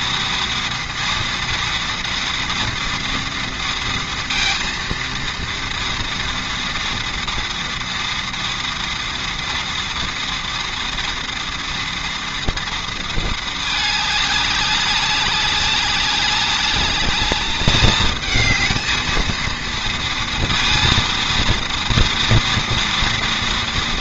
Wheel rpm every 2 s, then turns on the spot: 230, 230, 230, 230, 230, 230, 220, 200, 210, 230, 230, 230.
none